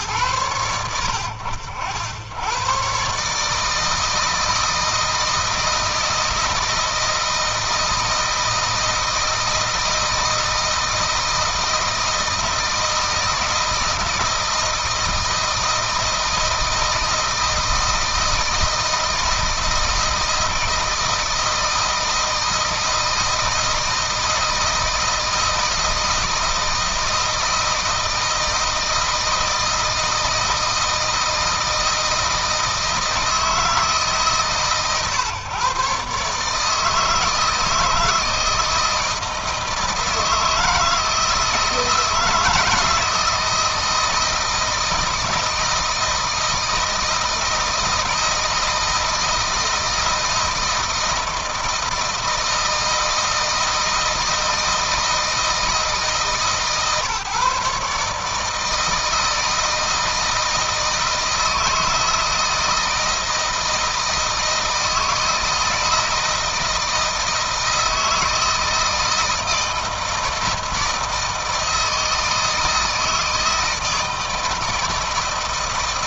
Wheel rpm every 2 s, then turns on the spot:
100, 110, 160, 160, 160, 160, 160, 160, 160, 160, 160, 160, 160, 160, 160, 160, 160, 140, 150, 160, 160, 160, 160, 160, 160, 160, 160, 160, 150, 160, 160, 160, 160, 160, 160, 160, 160, 160.
none